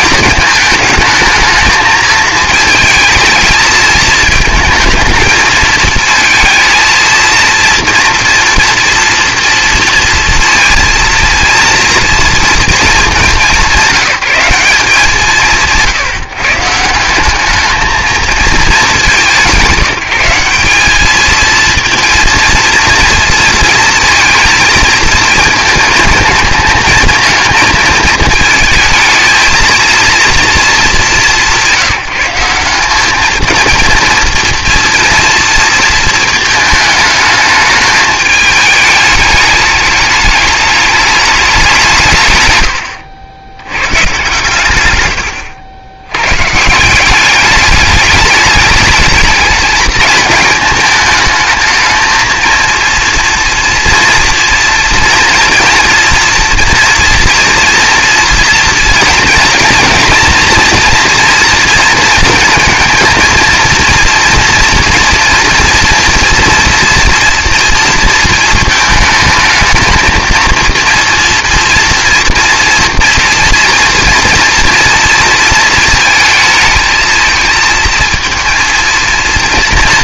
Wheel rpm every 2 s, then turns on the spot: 220, 220, 220, 230, 230, 230, 230, 190, 160, 220, 190, 230, 230, 220, 220, 220, 190, 230, 220, 210, 210, 110, 120, 140, 210, 220, 230, 230, 230, 230, 230, 230, 240, 230, 220, 230, 240, 230, 220, 230.
none